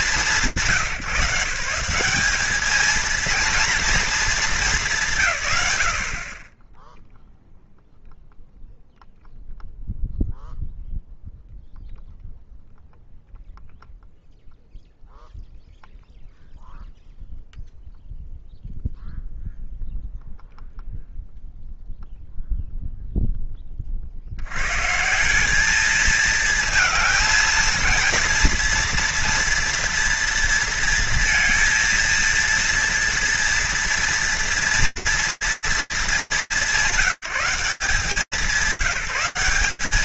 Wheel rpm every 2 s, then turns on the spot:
150, 220, 140, 0, 0, 0, 0, 0, 0, 0, 0, 0, 120, 230, 230, 230, 230, 230, 190, 190.
none